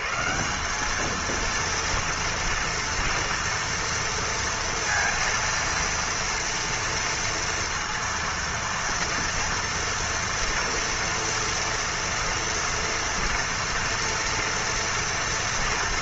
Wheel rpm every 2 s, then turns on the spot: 170, 230, 230, 230, 230, 230, 230, 230.
none